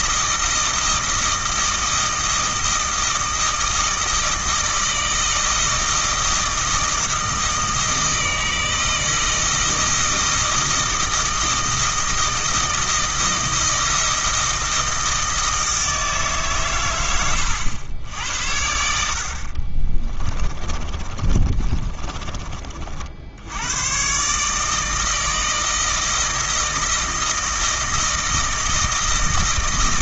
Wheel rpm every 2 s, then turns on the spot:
160, 160, 160, 160, 160, 160, 160, 160, 130, 80, 30, 40, 160, 160, 160.
20-22